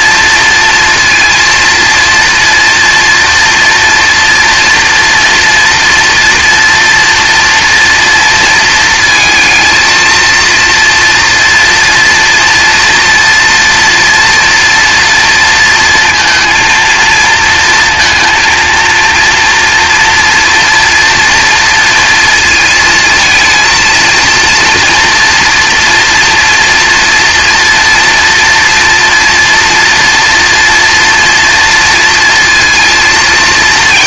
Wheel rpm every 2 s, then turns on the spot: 230, 230, 230, 230, 230, 230, 230, 230, 230, 230, 230, 230, 230, 230, 240, 230, 230.
none